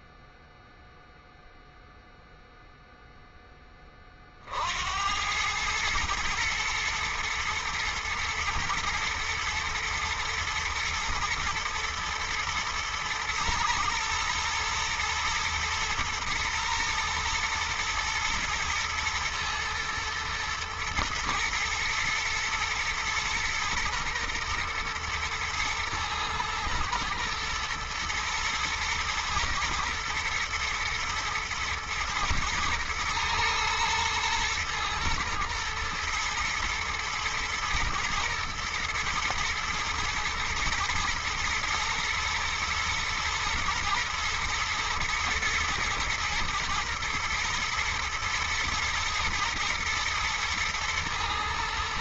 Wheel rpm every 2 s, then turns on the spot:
0, 0, 70, 120, 110, 120, 120, 120, 120, 110, 120, 110, 120, 110, 120, 120, 110, 110, 120, 110, 120, 120, 120, 110, 110, 110.
none